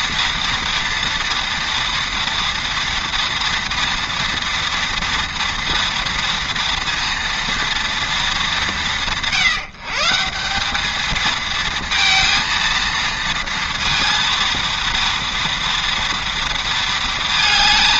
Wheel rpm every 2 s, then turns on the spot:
230, 230, 230, 230, 180, 200, 230, 230, 230.
none